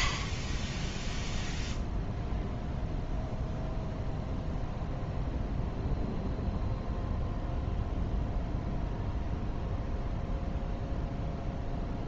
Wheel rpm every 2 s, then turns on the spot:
10, 0, 0, 0, 0, 0.
none